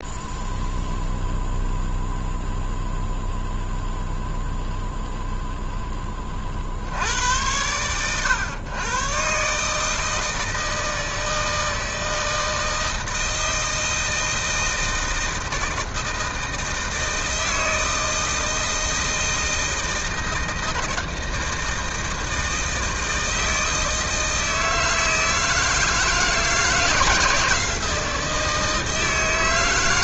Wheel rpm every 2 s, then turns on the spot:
0, 0, 0, 70, 120, 160, 160, 160, 160, 160, 160, 160, 160, 160, 160.
none